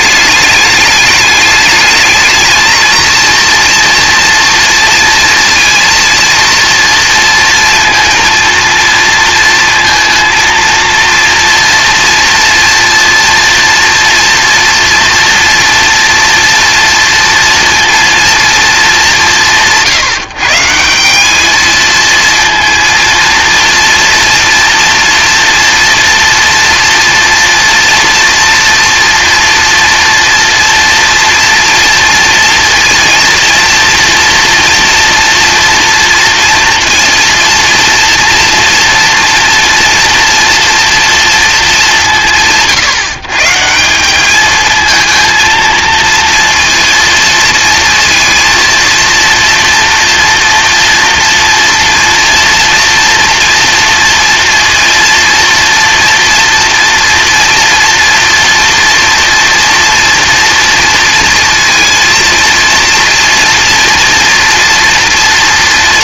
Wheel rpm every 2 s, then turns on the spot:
210, 220, 230, 230, 230, 230, 230, 230, 230, 220, 150, 230, 240, 230, 230, 240, 230, 230, 230, 230, 230, 150, 220, 230, 230, 230, 230, 230, 240, 240, 230, 230, 240.
none